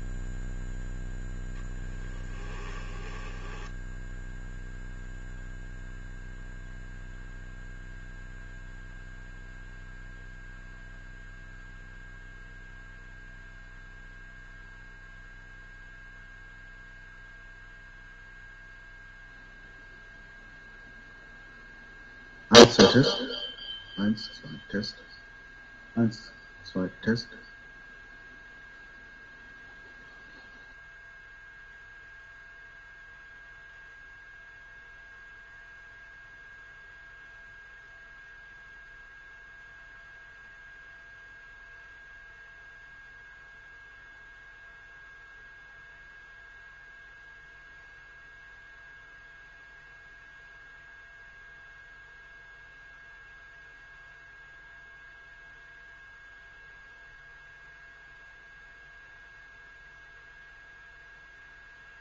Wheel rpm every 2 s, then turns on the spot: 0, 10, 0, 0, 0, 0, 0, 0, 0, 0, 0, 0, 0, 0, 0, 0, 0, 0, 0, 0, 0, 0, 0, 0, 0, 0, 0, 0, 0, 0, 0.
2-4